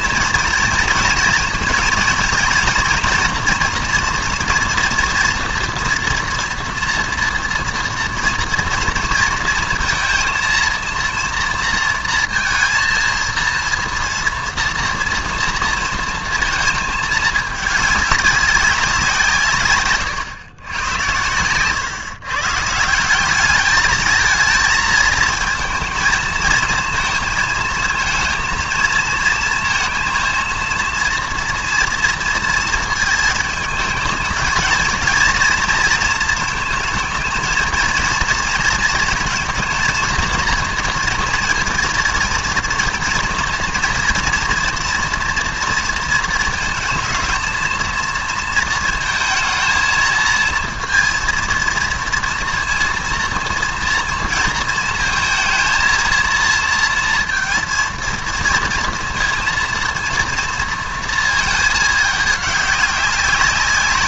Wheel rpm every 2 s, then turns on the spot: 230, 230, 240, 230, 230, 230, 230, 230, 220, 190, 110, 150, 220, 220, 230, 230, 230, 230, 220, 230, 230, 230, 230, 230, 230, 230, 230, 230, 230, 230, 230, 210.
none